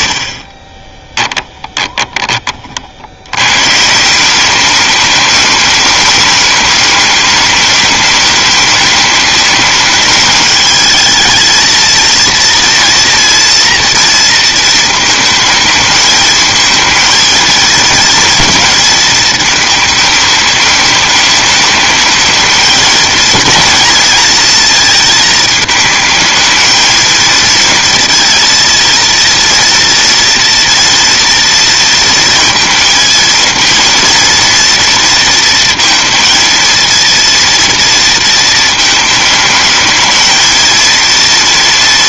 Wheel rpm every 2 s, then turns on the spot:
20, 30, 200, 210, 210, 210, 230, 230, 220, 230, 210, 220, 230, 220, 230, 230, 230, 230, 220, 220, 230.
0-2